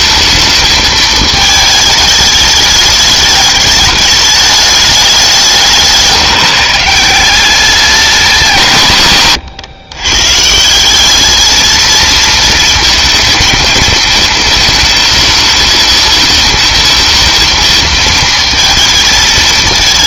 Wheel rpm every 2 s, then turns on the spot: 220, 210, 210, 160, 170, 160, 230, 220, 220, 230.
none